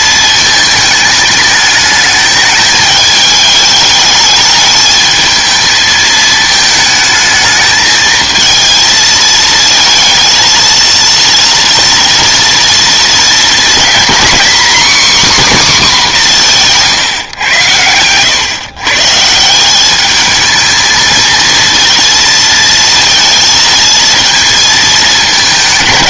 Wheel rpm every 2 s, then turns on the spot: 220, 210, 210, 220, 230, 230, 230, 270, 170, 140, 220, 230, 220.
none